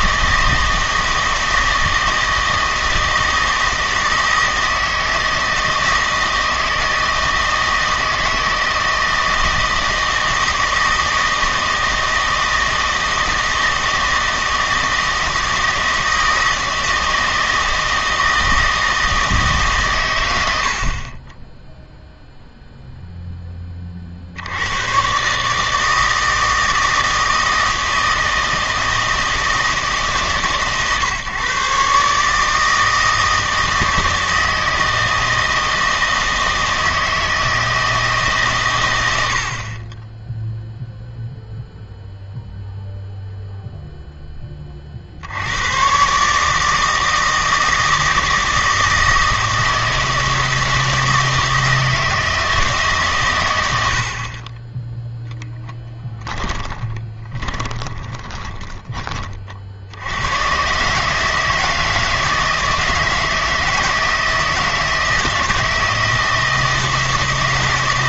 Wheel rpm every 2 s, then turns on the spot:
160, 160, 160, 160, 160, 160, 160, 160, 160, 160, 70, 0, 90, 160, 160, 140, 160, 160, 160, 120, 0, 0, 30, 160, 160, 160, 150, 20, 10, 20, 120, 160, 160, 160.
56-60